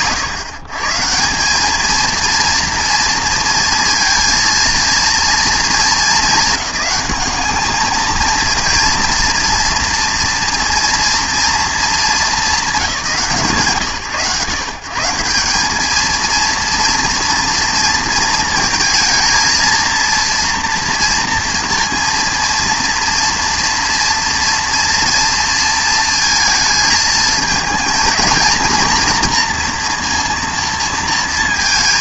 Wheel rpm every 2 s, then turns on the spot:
140, 230, 230, 210, 230, 240, 200, 120, 230, 220, 230, 230, 230, 230, 230, 230.
none